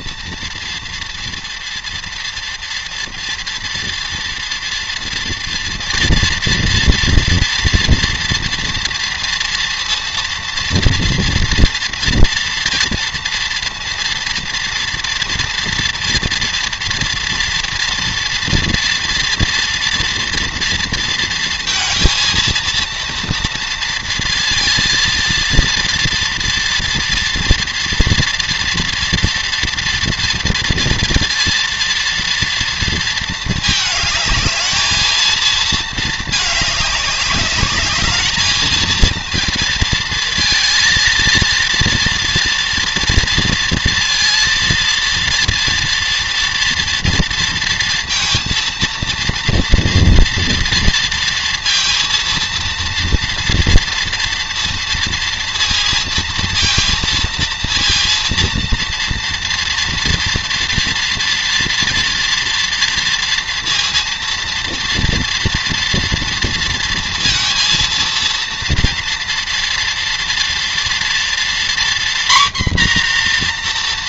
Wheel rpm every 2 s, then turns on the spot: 230, 230, 230, 230, 230, 230, 230, 230, 230, 230, 230, 230, 230, 230, 230, 230, 230, 220, 200, 220, 230, 230, 230, 230, 230, 230, 230, 230, 230, 230, 230, 230, 230, 230, 230, 240, 240.
none